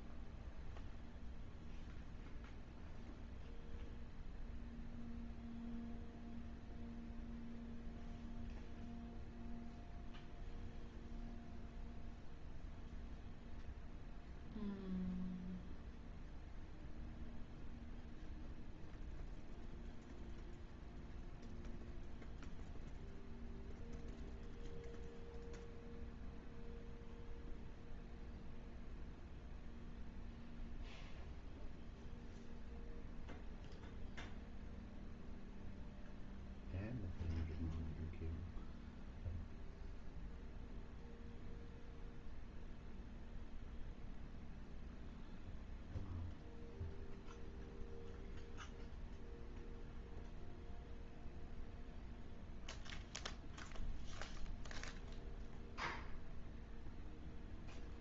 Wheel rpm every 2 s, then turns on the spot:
0, 0, 0, 0, 0, 0, 0, 0, 0, 0, 0, 0, 0, 0, 0, 0, 0, 0, 0, 0, 0, 0, 0, 0, 0, 0, 0, 0, 0.
none